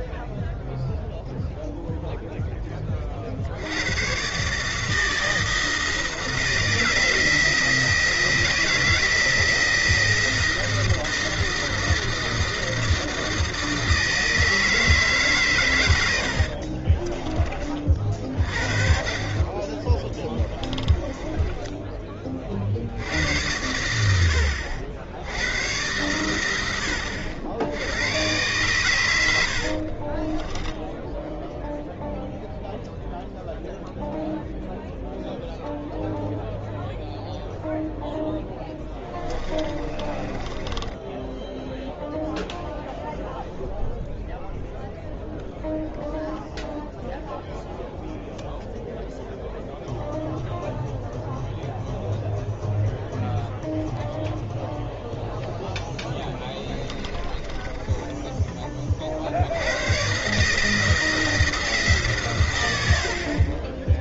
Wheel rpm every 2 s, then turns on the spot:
0, 10, 150, 170, 160, 160, 160, 160, 50, 50, 20, 40, 70, 100, 120, 10, 0, 0, 0, 10, 20, 0, 0, 0, 0, 0, 0, 0, 10, 30, 150, 110.
16-18 20-22 30-32 38-42 56-58